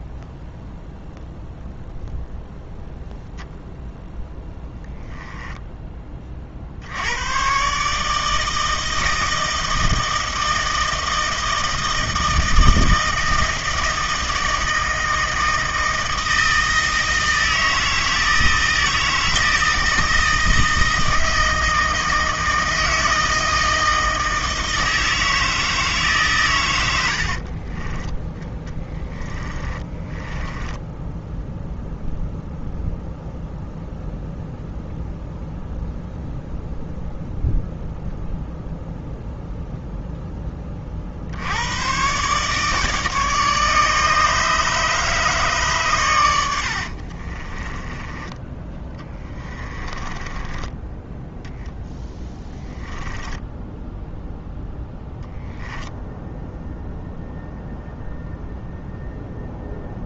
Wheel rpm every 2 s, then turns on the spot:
0, 0, 10, 60, 160, 160, 160, 160, 160, 160, 160, 160, 160, 100, 10, 10, 0, 0, 0, 0, 30, 150, 150, 70, 10, 10, 10, 0, 0, 0.
4-6 28-32 46-54